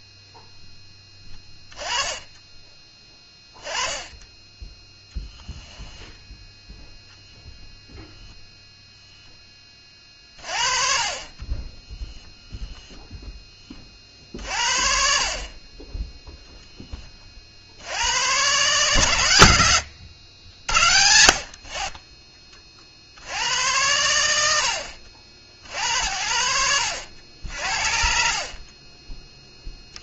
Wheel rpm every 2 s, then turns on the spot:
10, 10, 10, 0, 0, 40, 0, 50, 20, 130, 70, 50, 80, 80, 30.
none